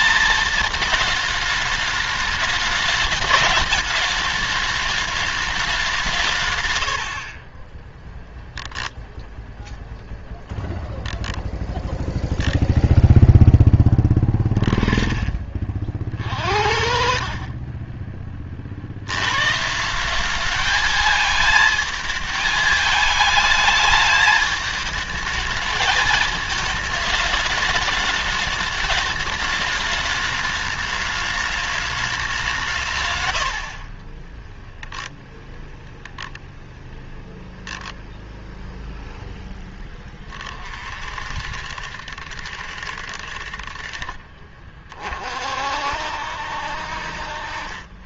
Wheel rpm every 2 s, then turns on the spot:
220, 210, 210, 150, 0, 0, 0, 20, 50, 50, 210, 220, 220, 220, 210, 210, 170, 10, 0, 0, 40, 60, 30, 60.
14-18